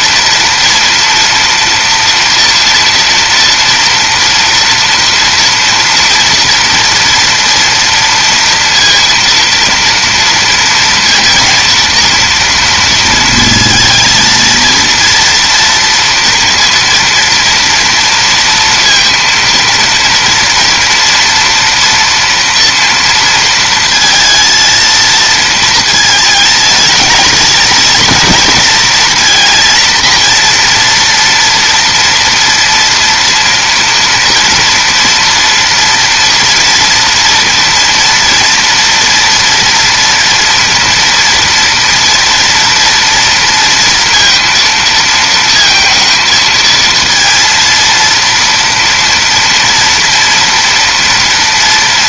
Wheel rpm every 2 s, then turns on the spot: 230, 230, 230, 230, 230, 220, 230, 230, 230, 230, 230, 230, 230, 220, 230, 230, 230, 230, 240, 230, 230, 230, 230, 230, 230, 230.
none